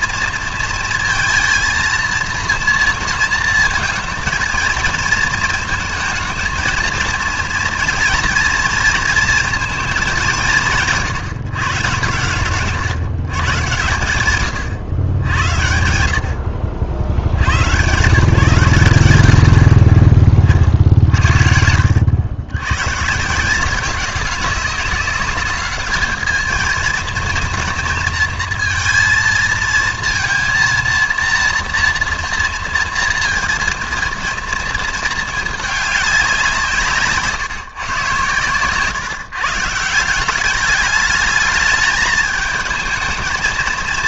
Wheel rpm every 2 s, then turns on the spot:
230, 230, 220, 220, 230, 160, 140, 120, 60, 140, 50, 110, 190, 220, 230, 230, 230, 230, 160, 120, 200, 220.
none